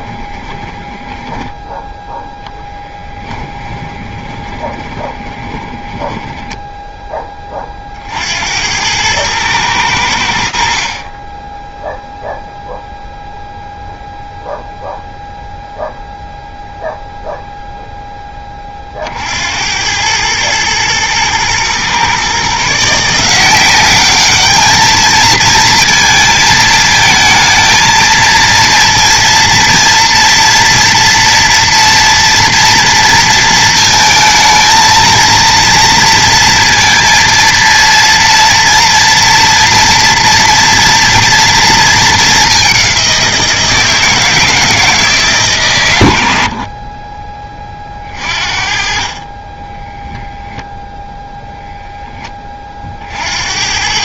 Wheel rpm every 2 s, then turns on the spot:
10, 10, 20, 10, 100, 30, 0, 0, 0, 50, 110, 160, 220, 220, 230, 230, 230, 230, 230, 230, 230, 180, 160, 30, 40, 0, 30.
0-6